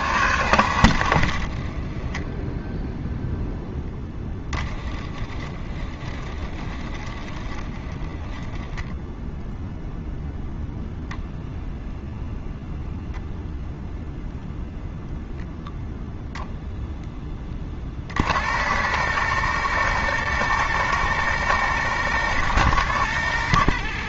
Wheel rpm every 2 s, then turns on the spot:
90, 0, 20, 30, 0, 0, 0, 0, 60, 120, 110, 90.
none